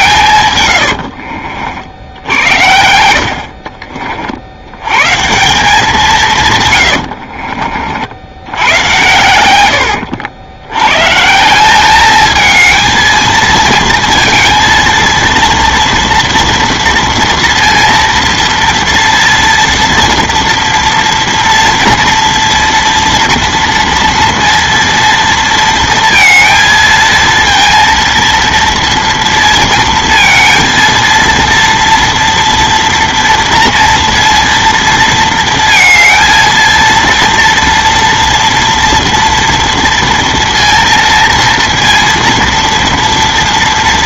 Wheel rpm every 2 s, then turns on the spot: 100, 60, 90, 120, 100, 100, 220, 230, 230, 230, 230, 230, 230, 230, 230, 230, 230, 230, 230, 230, 230, 230.
0-2